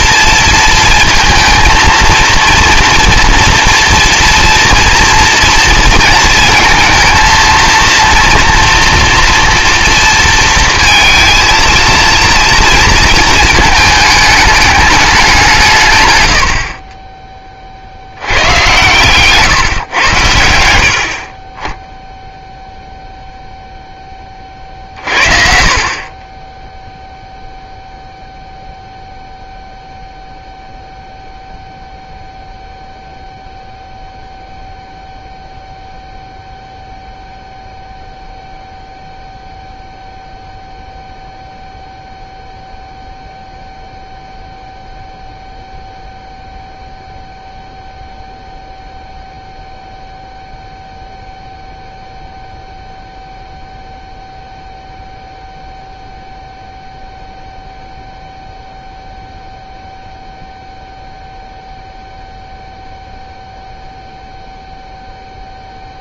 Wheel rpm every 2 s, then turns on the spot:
230, 230, 230, 230, 230, 230, 230, 210, 80, 110, 80, 0, 30, 10, 0, 0, 0, 0, 0, 0, 0, 0, 0, 0, 0, 0, 0, 0, 0, 0, 0, 0, 0.
none